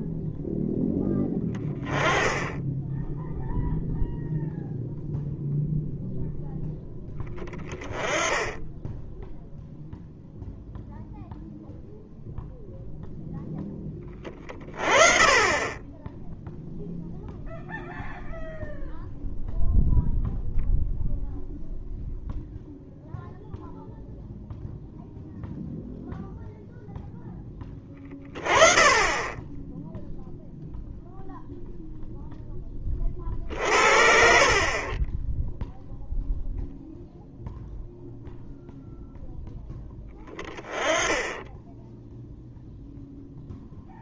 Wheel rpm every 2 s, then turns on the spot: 10, 0, 0, 10, 10, 0, 0, 30, 0, 0, 0, 0, 0, 0, 30, 0, 30, 20, 0, 0, 10, 0.
none